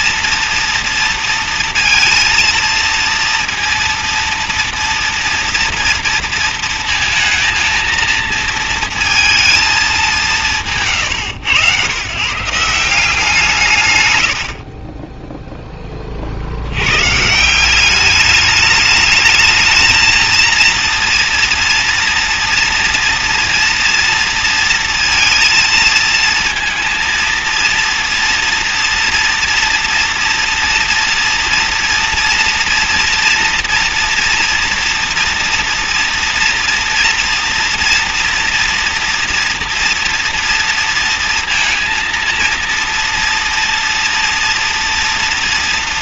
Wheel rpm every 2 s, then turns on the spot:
230, 230, 230, 230, 200, 130, 110, 20, 190, 220, 230, 230, 220, 230, 240, 230, 230, 240, 240, 230, 230, 240, 230.
12-14